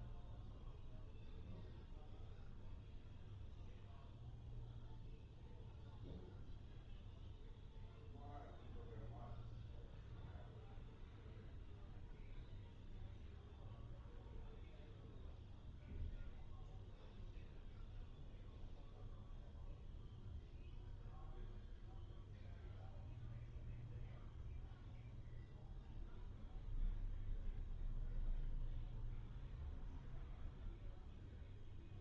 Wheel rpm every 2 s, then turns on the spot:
0, 0, 0, 0, 0, 0, 0, 0, 0, 0, 0, 0, 0, 0, 0, 0.
none